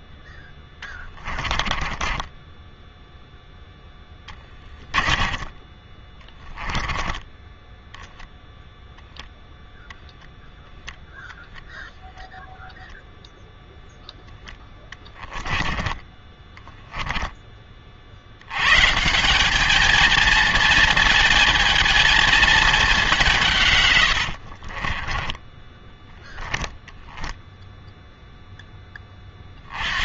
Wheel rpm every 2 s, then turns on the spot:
10, 10, 20, 10, 0, 0, 0, 10, 10, 120, 230, 210, 40, 10, 10.
0-8 14-16 24-28